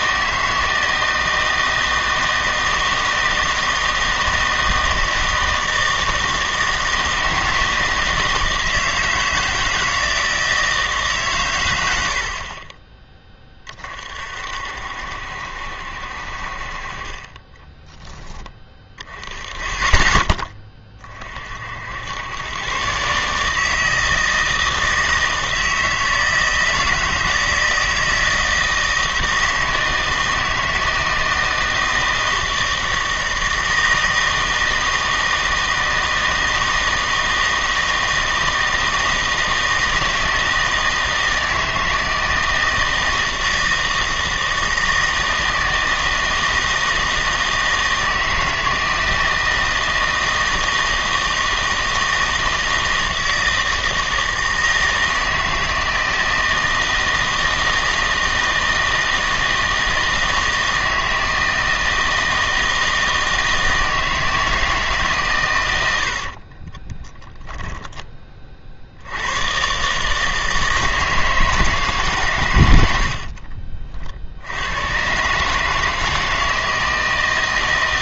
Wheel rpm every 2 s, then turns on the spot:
160, 160, 160, 160, 160, 160, 30, 60, 40, 20, 20, 120, 160, 160, 160, 160, 160, 160, 160, 160, 160, 160, 160, 160, 160, 160, 160, 160, 160, 160, 160, 160, 160, 30, 50, 160, 100, 100, 160.
66-68